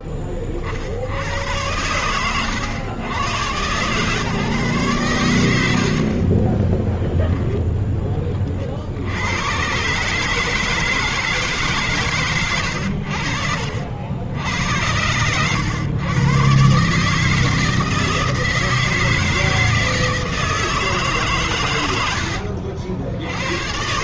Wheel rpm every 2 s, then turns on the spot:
30, 110, 120, 30, 30, 150, 120, 80, 130, 160, 160, 90.
6-8 22-24